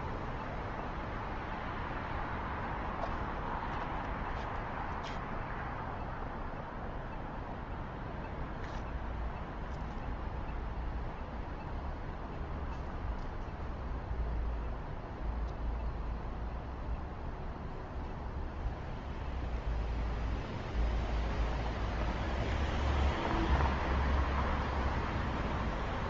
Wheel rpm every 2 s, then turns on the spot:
0, 0, 0, 0, 0, 0, 0, 0, 0, 0, 0, 0, 0.
none